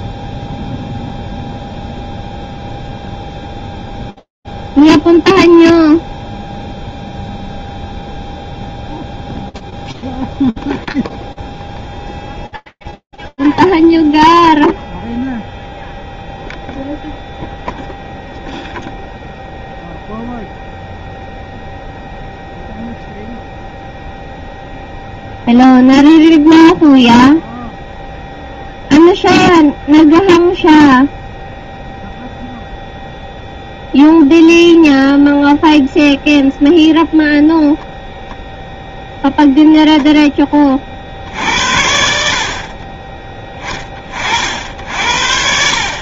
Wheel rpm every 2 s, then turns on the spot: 0, 0, 0, 0, 0, 0, 0, 0, 0, 0, 0, 0, 0, 0, 0, 0, 0, 0, 0, 10, 70, 40, 110.
none